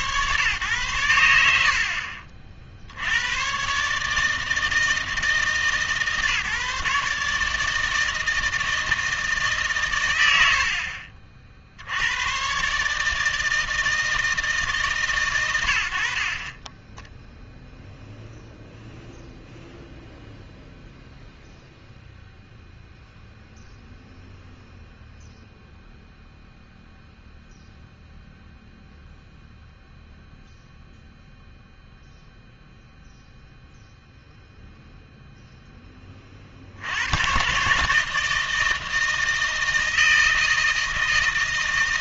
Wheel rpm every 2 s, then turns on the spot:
120, 60, 160, 150, 160, 70, 130, 150, 30, 0, 0, 0, 0, 0, 0, 0, 0, 0, 60, 160, 160.
none